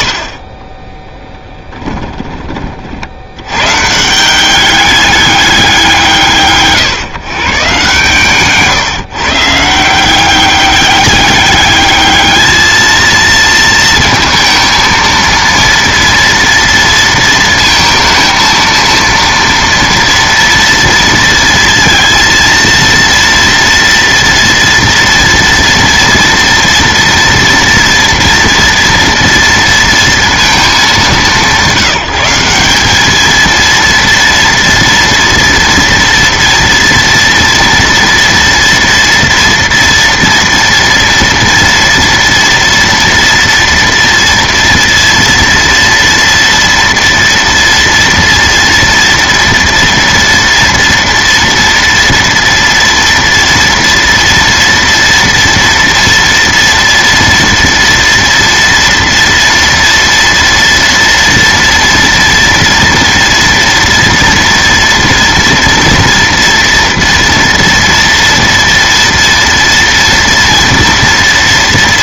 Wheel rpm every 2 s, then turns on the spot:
10, 50, 200, 140, 140, 200, 220, 230, 230, 230, 230, 230, 230, 230, 230, 200, 210, 230, 230, 230, 230, 230, 230, 230, 230, 230, 230, 230, 230, 230, 230, 230, 230, 230, 230, 230.
0-2